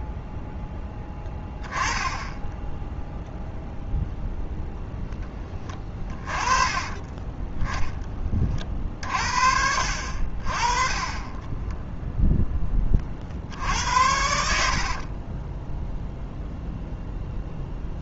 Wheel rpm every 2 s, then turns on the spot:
0, 0, 0, 20, 40, 30, 20, 60, 0.
6-8 14-16